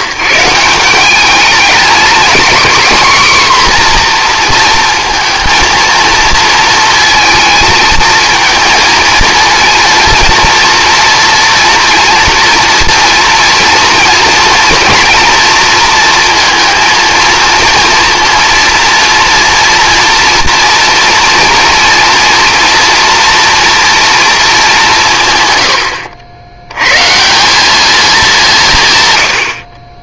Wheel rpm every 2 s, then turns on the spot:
170, 230, 240, 230, 220, 230, 230, 230, 230, 230, 230, 230, 210, 100, 170.
none